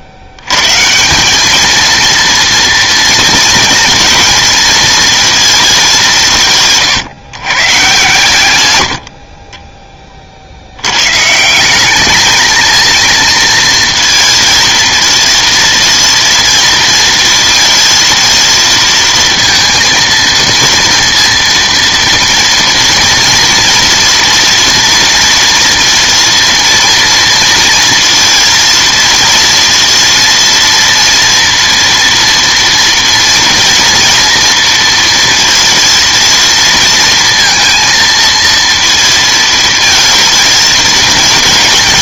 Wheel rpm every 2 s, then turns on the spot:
110, 230, 230, 150, 100, 70, 220, 230, 230, 220, 230, 230, 230, 230, 230, 230, 230, 230, 230, 230, 220.
none